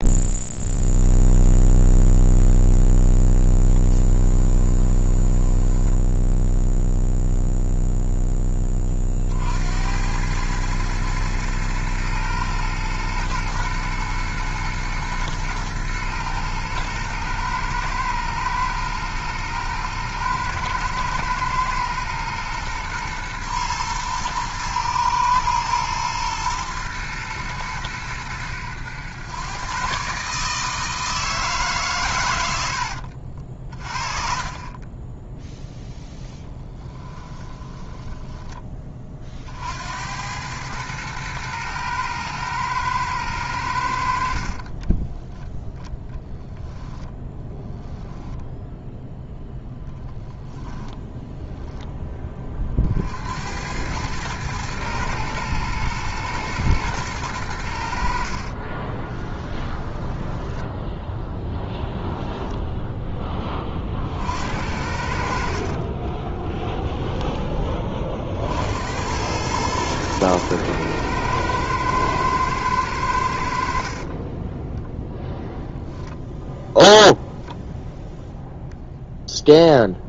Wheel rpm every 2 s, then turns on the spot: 0, 0, 10, 0, 10, 110, 110, 120, 110, 110, 110, 120, 110, 110, 100, 150, 90, 30, 20, 10, 100, 110, 60, 10, 10, 0, 30, 110, 120, 50, 10, 10, 70, 20, 80, 110, 110, 10, 0, 0.
4-6 32-34 36-38 44-46 58-62